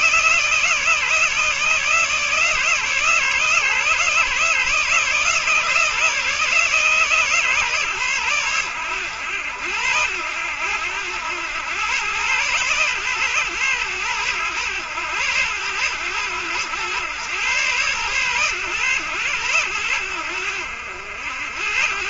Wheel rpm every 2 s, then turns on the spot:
150, 150, 150, 150, 100, 100, 120, 110, 110, 110, 80.
none